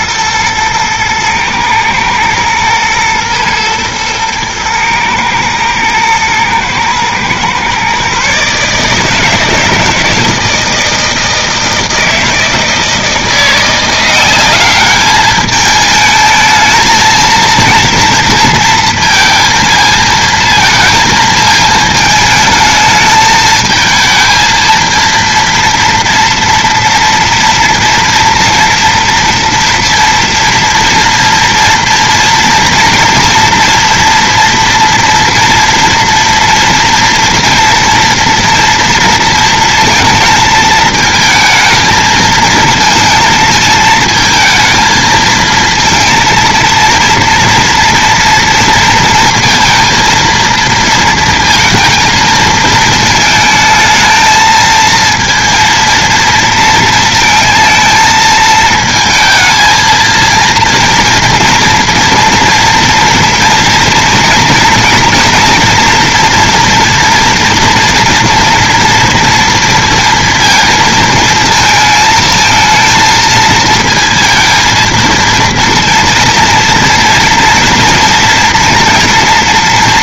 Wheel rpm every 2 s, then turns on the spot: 110, 120, 110, 110, 150, 160, 160, 200, 220, 230, 220, 220, 230, 230, 230, 240, 230, 230, 230, 230, 220, 220, 220, 230, 230, 230, 230, 230, 230, 220, 230, 230, 230, 230, 230, 230, 220, 230, 230, 230.
none